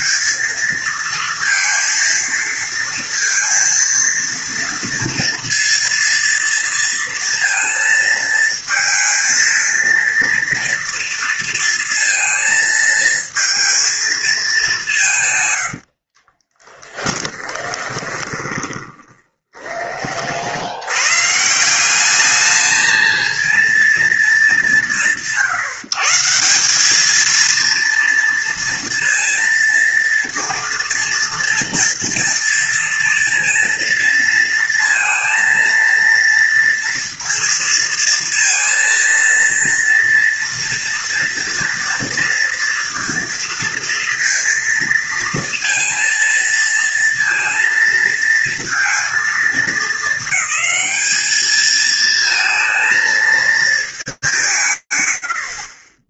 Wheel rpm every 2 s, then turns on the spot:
230, 230, 230, 230, 230, 230, 230, 160, 10, 20, 110, 220, 170, 210, 230, 230, 230, 230, 230, 230, 230, 230, 230, 230, 230, 210, 220, 30.
16-20